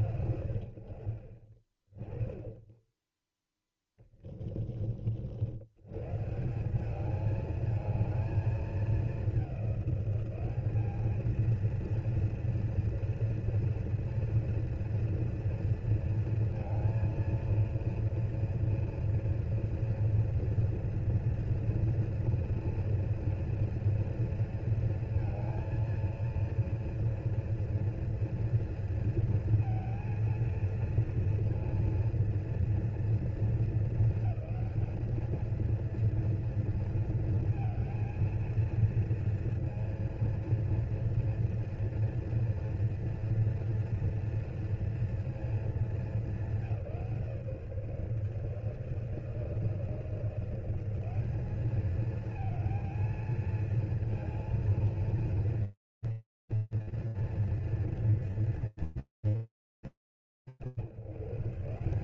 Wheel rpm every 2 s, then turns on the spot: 100, 10, 20, 170, 220, 210, 230, 240, 230, 230, 230, 230, 230, 230, 230, 230, 230, 210, 230, 230, 230, 230, 230, 190, 150, 170, 230, 230, 210, 150, 230.
none